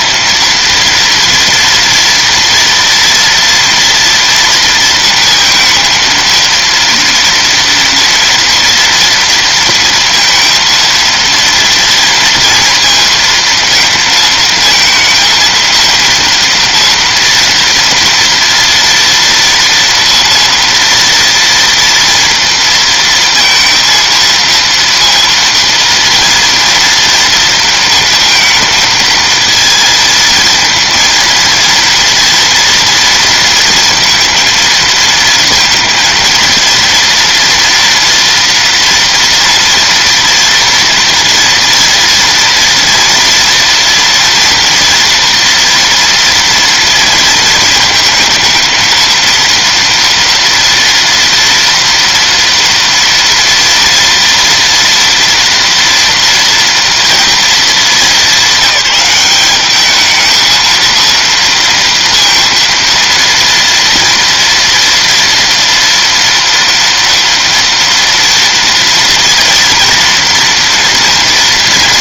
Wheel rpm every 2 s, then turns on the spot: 230, 230, 230, 230, 230, 230, 230, 220, 230, 240, 230, 230, 230, 230, 230, 230, 230, 230, 230, 230, 230, 230, 230, 230, 220, 230, 230, 230, 240, 210, 230, 230, 230, 230, 230, 240.
none